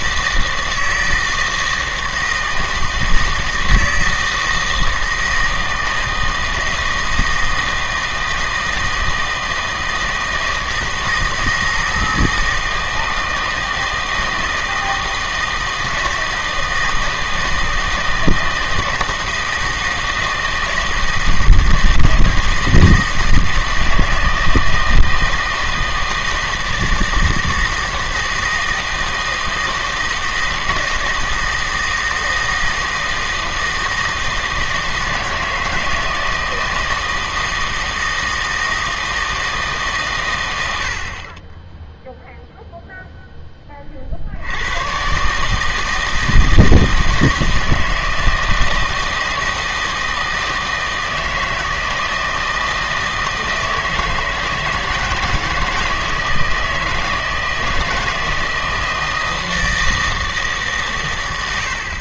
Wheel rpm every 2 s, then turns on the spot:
160, 160, 160, 160, 160, 160, 160, 160, 160, 160, 160, 160, 160, 160, 160, 160, 160, 160, 160, 160, 80, 0, 100, 160, 160, 160, 160, 160, 160, 160, 150.
none